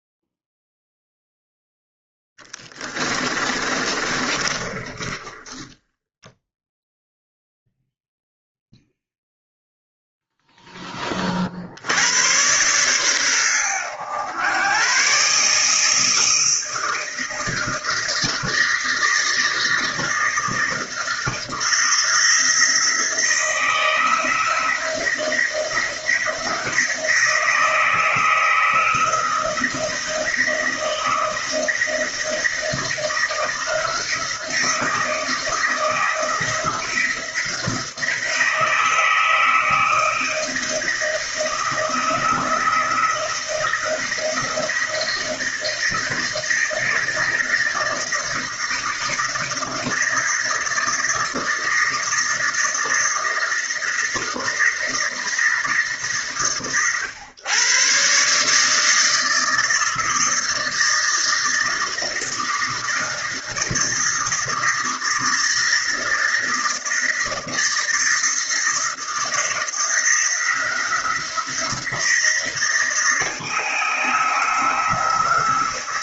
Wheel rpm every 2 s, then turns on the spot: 0, 30, 30, 0, 0, 30, 120, 130, 160, 160, 160, 160, 170, 160, 160, 160, 160, 170, 170, 160, 160, 160, 160, 160, 160, 160, 160, 160, 110, 160, 160, 160, 160, 160, 160, 170, 160, 160.
2-6